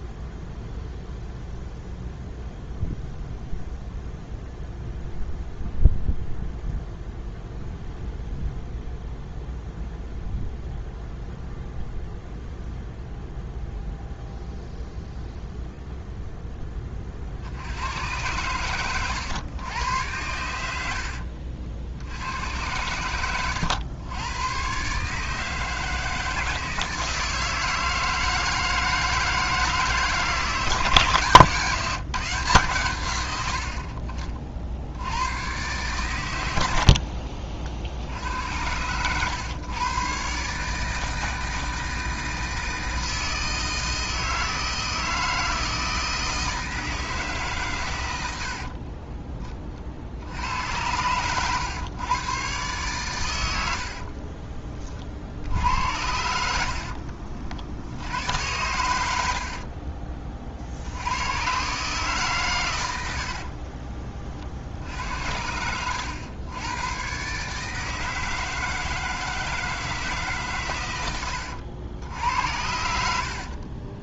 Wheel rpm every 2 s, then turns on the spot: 0, 0, 0, 0, 0, 0, 0, 0, 10, 110, 100, 90, 120, 160, 160, 160, 140, 60, 90, 90, 140, 160, 160, 160, 60, 90, 130, 30, 70, 100, 50, 120, 50, 100, 160, 130, 80.
48-50 56-58